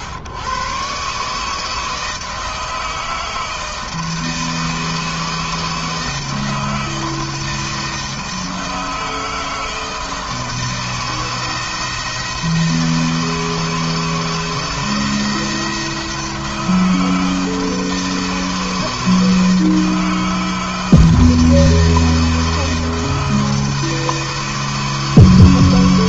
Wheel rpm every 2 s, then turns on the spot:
140, 160, 160, 160, 160, 160, 160, 160, 160, 160, 160, 160, 160.
none